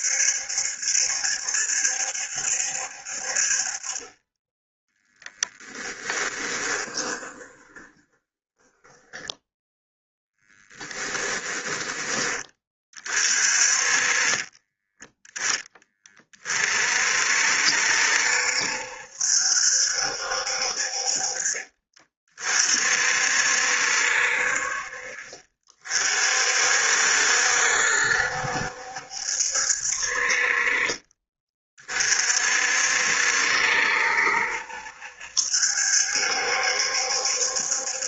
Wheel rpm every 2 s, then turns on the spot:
70, 60, 10, 20, 10, 10, 30, 10, 50, 70, 50, 50, 50, 60, 70, 30, 60, 70, 70.
6-12